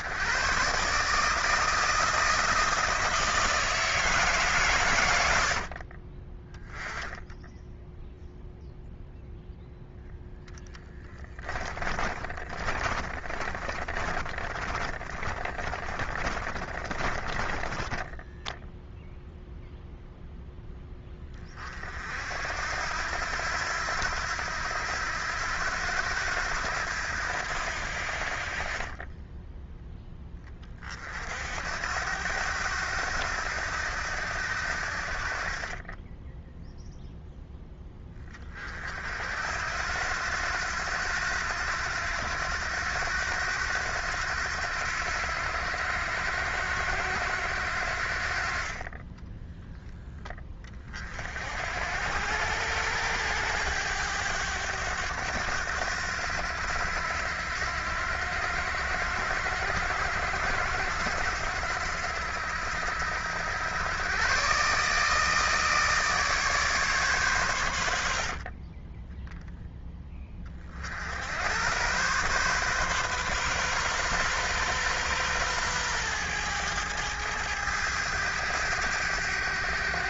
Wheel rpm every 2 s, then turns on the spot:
130, 160, 110, 10, 0, 10, 30, 30, 30, 0, 10, 80, 90, 90, 30, 30, 90, 60, 0, 40, 90, 90, 90, 90, 30, 30, 100, 100, 90, 90, 90, 90, 140, 140, 30, 60, 130, 130, 110, 100.
10-18 28-30 68-70